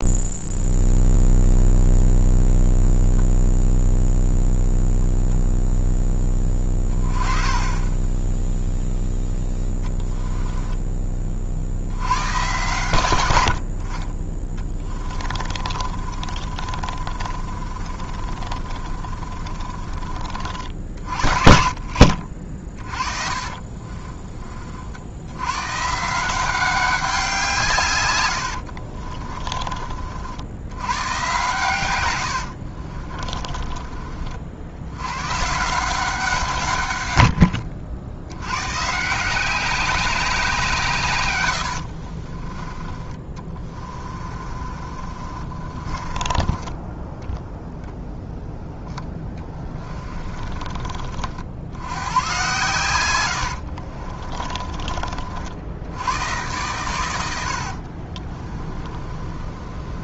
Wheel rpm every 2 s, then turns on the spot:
0, 0, 0, 20, 0, 20, 110, 20, 40, 40, 50, 40, 60, 190, 50, 110, 50, 90, 120, 150, 150, 20, 40, 10, 10, 40, 110, 40, 110, 30.
14-20 22-24 28-30 32-34 42-46 48-50 58-60